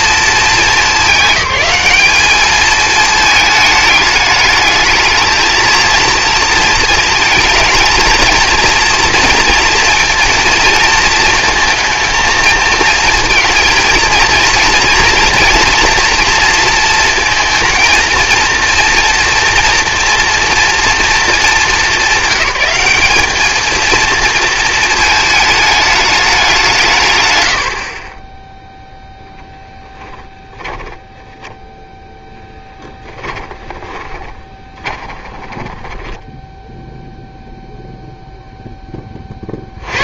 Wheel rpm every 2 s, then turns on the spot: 210, 210, 220, 230, 220, 230, 230, 230, 230, 230, 240, 200, 230, 170, 0, 10, 10, 20, 10, 10.
30-38